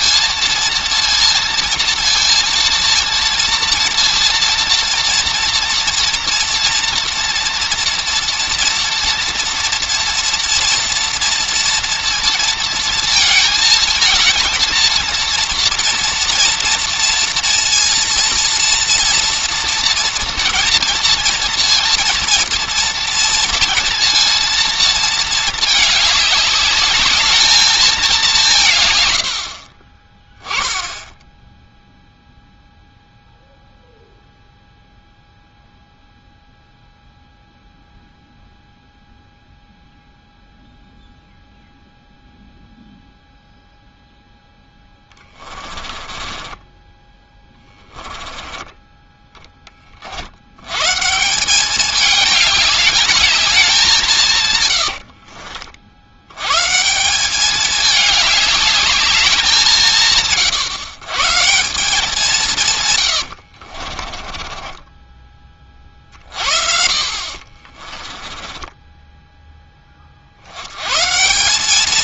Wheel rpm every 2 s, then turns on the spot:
230, 230, 230, 240, 230, 230, 230, 230, 230, 230, 230, 230, 230, 200, 140, 10, 0, 0, 0, 0, 0, 0, 10, 20, 10, 120, 210, 80, 140, 210, 130, 140, 20, 40, 20, 100.
44-50 54-56 64-66 68-70